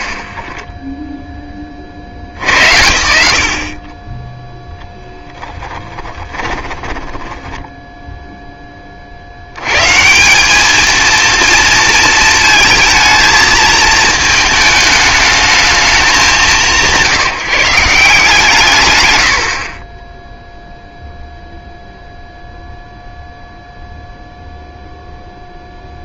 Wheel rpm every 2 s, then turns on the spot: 30, 110, 0, 10, 10, 210, 230, 220, 170, 120, 0, 0, 0.
6-8